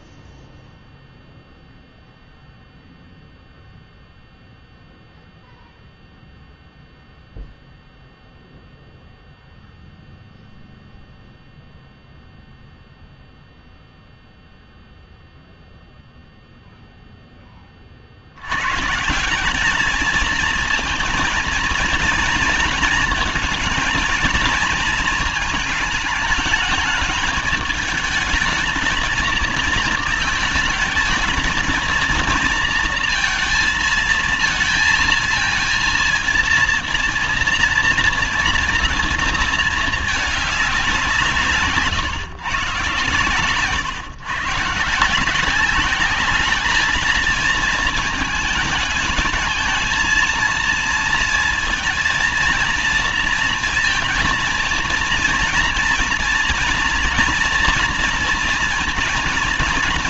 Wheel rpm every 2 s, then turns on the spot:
0, 0, 0, 0, 0, 0, 0, 0, 0, 100, 230, 230, 220, 210, 220, 220, 230, 230, 230, 230, 200, 130, 130, 210, 220, 230, 230, 230, 230, 230.
none